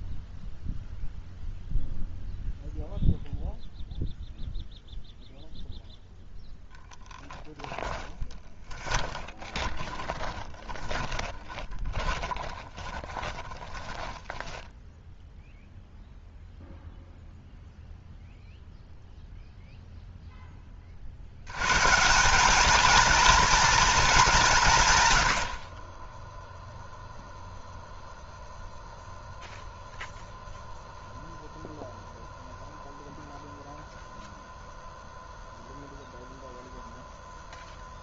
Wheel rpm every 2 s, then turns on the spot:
0, 0, 0, 10, 10, 20, 30, 10, 0, 0, 20, 210, 170, 0, 0, 0, 0, 0, 0.
8-16